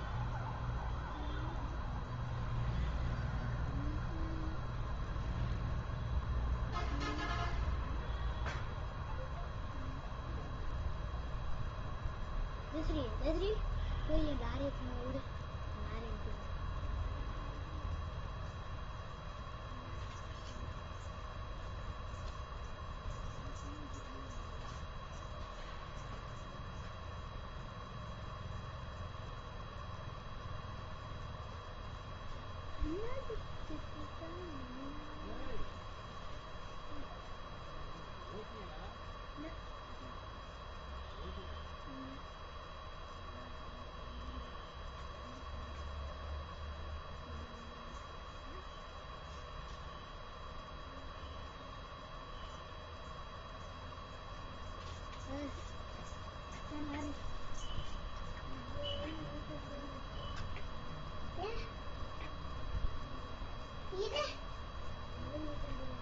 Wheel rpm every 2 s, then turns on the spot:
0, 0, 0, 0, 0, 0, 0, 0, 0, 0, 0, 0, 0, 0, 0, 0, 0, 0, 0, 0, 0, 0, 0, 0, 0, 0, 0, 0, 0, 0, 0, 0, 0.
none